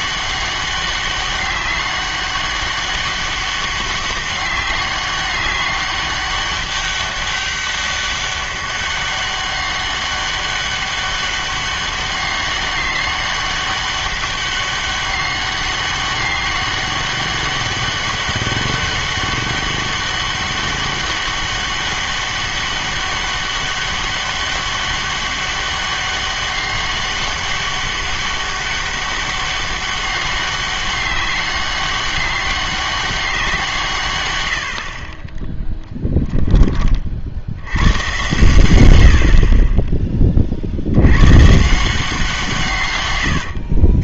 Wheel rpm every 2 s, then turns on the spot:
200, 200, 200, 200, 200, 200, 200, 200, 200, 200, 200, 200, 200, 200, 200, 190, 200, 100, 10, 110, 40, 160.
none